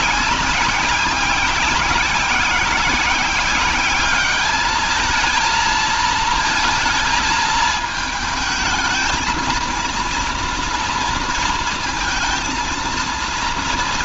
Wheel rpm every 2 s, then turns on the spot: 190, 190, 210, 220, 220, 230, 230.
none